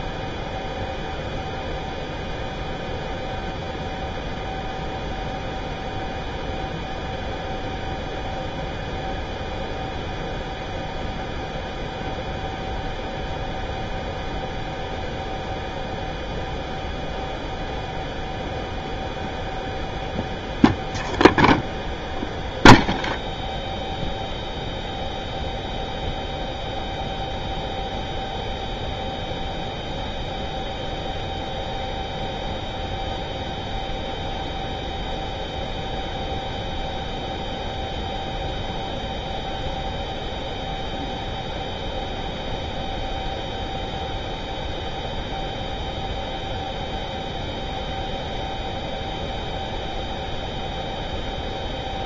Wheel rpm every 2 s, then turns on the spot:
0, 0, 0, 0, 0, 0, 0, 0, 0, 0, 0, 0, 0, 0, 0, 0, 0, 0, 0, 0, 0, 0, 0, 0, 0, 0.
none